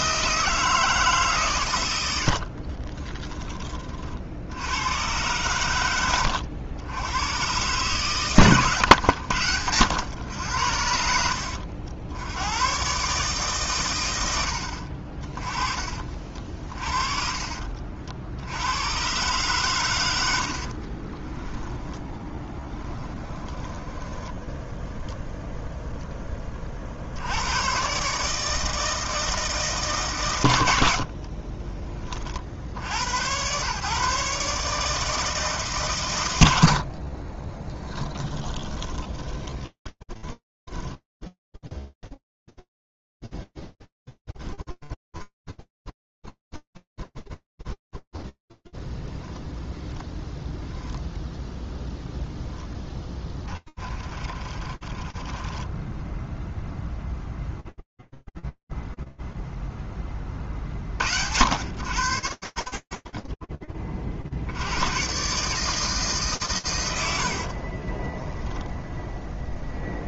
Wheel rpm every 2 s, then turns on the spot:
160, 60, 60, 90, 130, 80, 80, 90, 30, 60, 100, 10, 10, 10, 140, 130, 20, 130, 140, 20, 20, 10, 10, 0, 40, 150, 100, 10, 0, 50, 40, 150, 40, 0, 30.
2-4 6-8 16-18 22-26 38-44 54-56 64-66